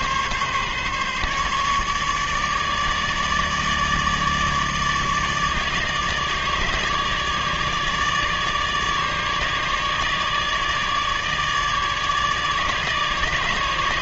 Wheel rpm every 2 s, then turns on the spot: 140, 150, 150, 150, 150, 150, 150.
none